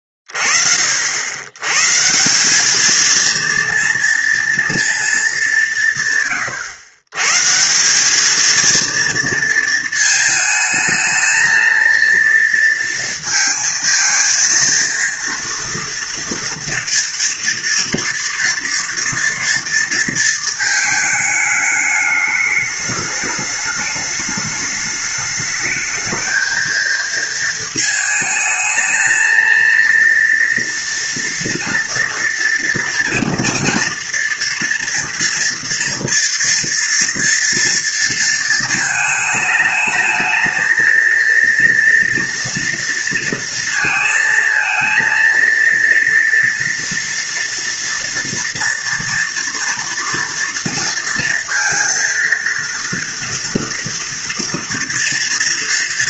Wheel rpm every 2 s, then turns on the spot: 20, 180, 230, 130, 220, 220, 230, 230, 230, 230, 230, 210, 210, 220, 220, 230, 240, 230, 230, 230, 220, 230, 230, 240, 230, 230, 230, 230.
none